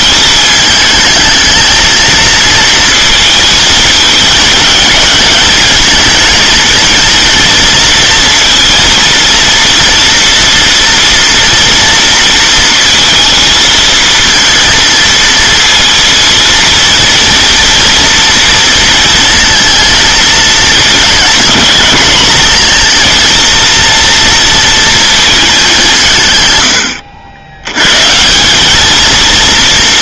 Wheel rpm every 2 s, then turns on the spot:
220, 230, 220, 230, 230, 230, 230, 230, 230, 230, 220, 220, 230, 110, 200.
none